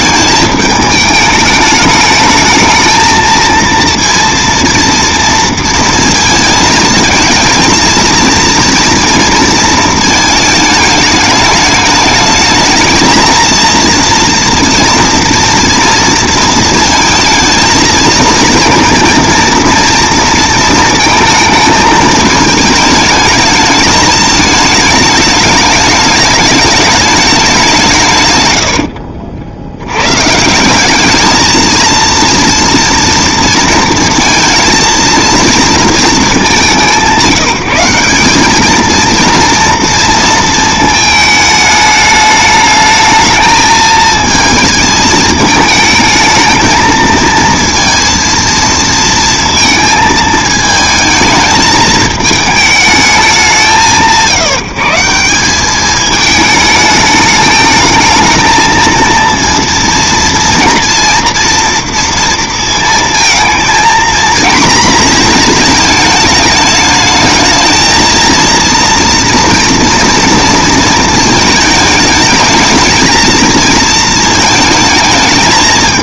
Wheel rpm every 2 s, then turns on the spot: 210, 220, 230, 220, 230, 220, 220, 230, 230, 230, 230, 220, 210, 210, 90, 180, 230, 230, 190, 210, 220, 210, 220, 220, 230, 220, 220, 160, 210, 220, 230, 230, 230, 220, 230, 230, 220, 220.
28-30